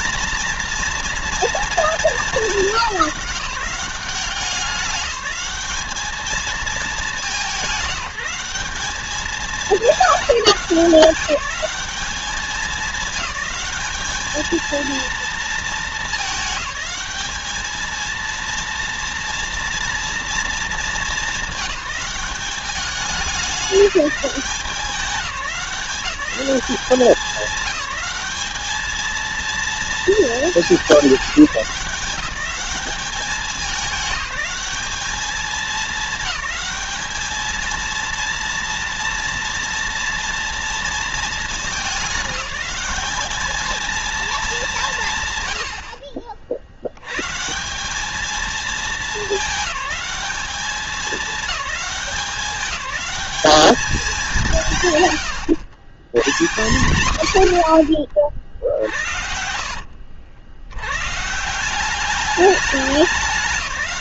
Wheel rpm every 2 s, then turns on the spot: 230, 210, 190, 210, 190, 200, 210, 220, 210, 230, 230, 200, 190, 190, 210, 210, 190, 210, 210, 230, 230, 200, 190, 70, 210, 200, 190, 140, 150, 50, 90, 200.
none